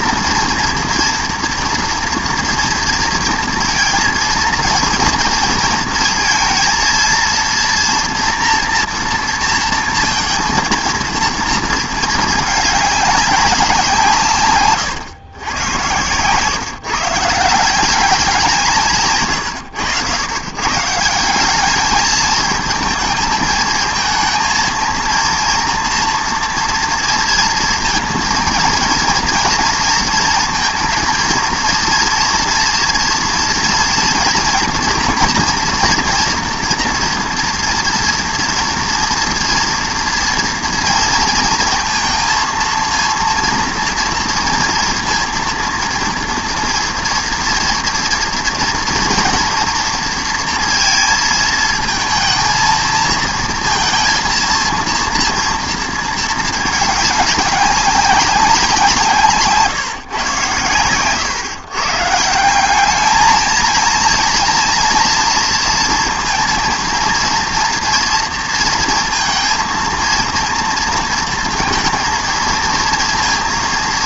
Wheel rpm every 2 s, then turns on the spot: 230, 230, 230, 230, 240, 230, 210, 130, 140, 180, 120, 220, 220, 230, 230, 230, 230, 230, 230, 230, 230, 230, 230, 230, 240, 230, 230, 230, 220, 190, 130, 180, 230, 230, 230, 230, 230.
none